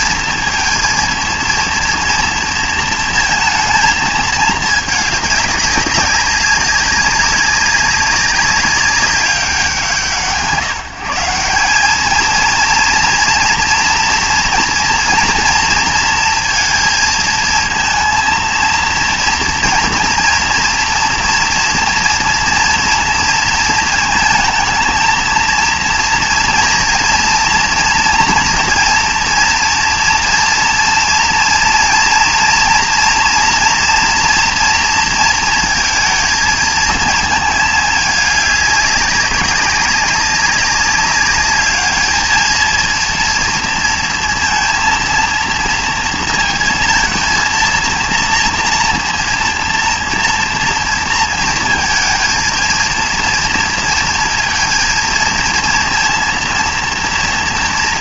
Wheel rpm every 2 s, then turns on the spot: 230, 230, 210, 200, 200, 150, 230, 230, 230, 230, 240, 230, 220, 230, 230, 230, 240, 230, 220, 200, 190, 220, 230, 230, 230, 230, 230, 230, 230.
none